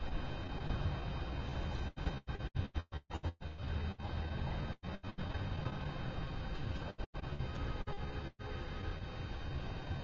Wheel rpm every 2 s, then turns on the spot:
0, 0, 0, 0, 0.
none